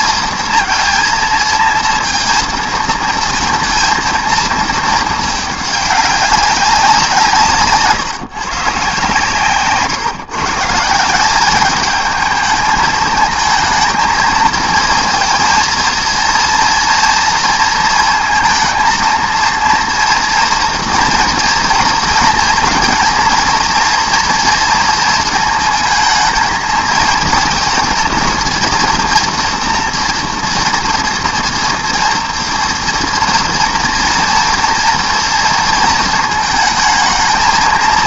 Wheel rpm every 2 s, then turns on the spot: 230, 230, 220, 190, 140, 160, 220, 220, 230, 230, 230, 230, 230, 230, 230, 230, 230, 230, 220.
none